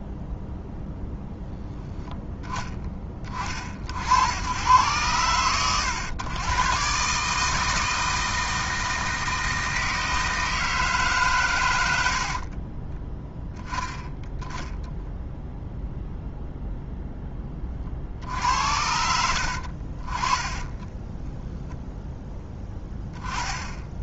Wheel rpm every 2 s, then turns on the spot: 10, 20, 110, 130, 160, 160, 30, 0, 0, 70, 20, 10.
20-22